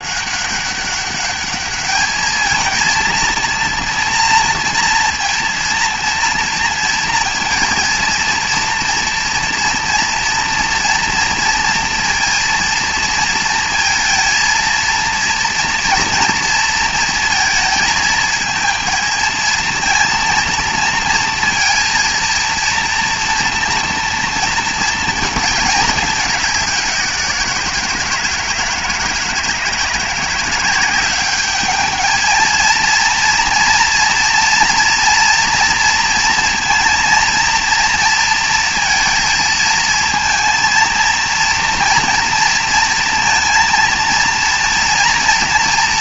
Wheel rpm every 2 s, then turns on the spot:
200, 230, 240, 230, 230, 230, 230, 230, 230, 230, 230, 230, 230, 190, 160, 190, 230, 230, 230, 230, 230, 230, 230.
none